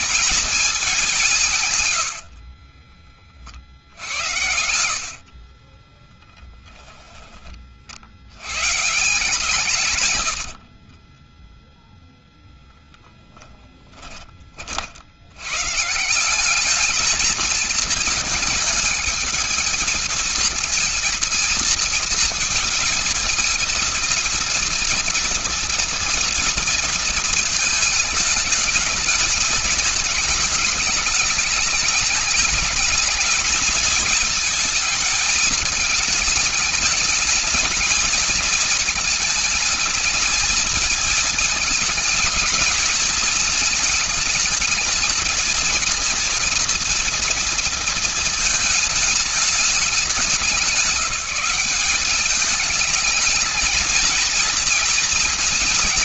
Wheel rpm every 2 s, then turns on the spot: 210, 50, 80, 20, 150, 20, 10, 150, 220, 220, 230, 230, 230, 220, 220, 210, 220, 220, 220, 220, 230, 220, 220, 230, 210, 190, 220, 220.
4-6 10-12